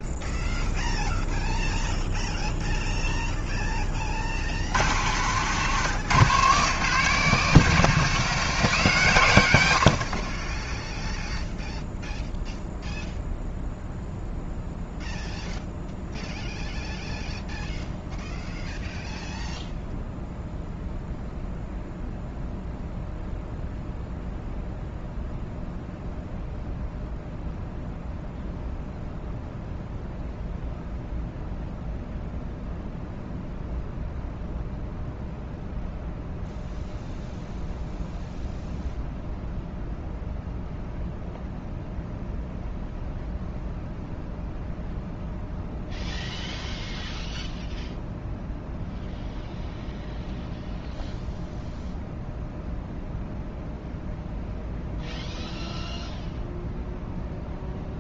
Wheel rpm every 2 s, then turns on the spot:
0, 0, 80, 150, 160, 20, 0, 0, 0, 0, 0, 0, 0, 0, 0, 0, 0, 0, 0, 0, 0, 0, 0, 0, 0, 0, 0, 0, 0.
10-12